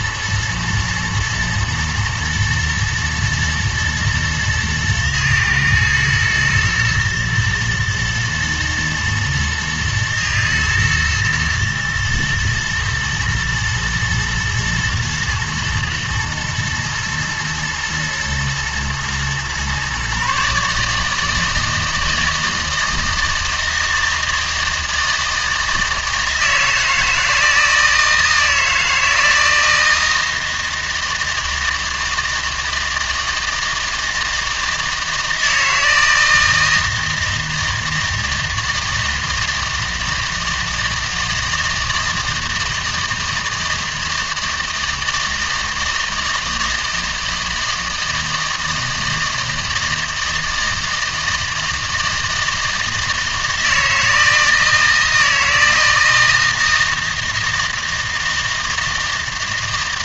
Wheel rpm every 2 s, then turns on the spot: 120, 110, 120, 110, 120, 120, 110, 110, 110, 120, 150, 160, 160, 160, 160, 160, 160, 160, 160, 160, 160, 160, 160, 160, 160, 160, 160, 160, 160, 160.
none